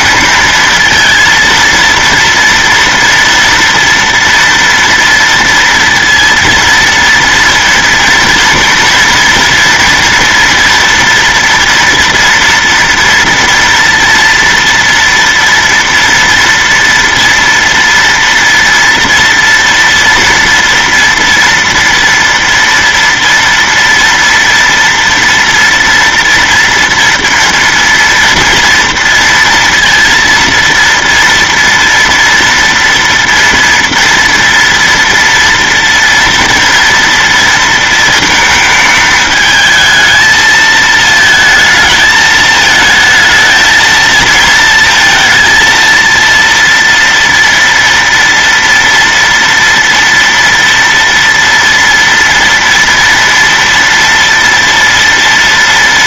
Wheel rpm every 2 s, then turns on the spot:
230, 230, 230, 230, 230, 230, 230, 230, 240, 230, 230, 230, 230, 230, 230, 230, 230, 230, 230, 220, 220, 220, 230, 230, 230, 240, 230, 230.
none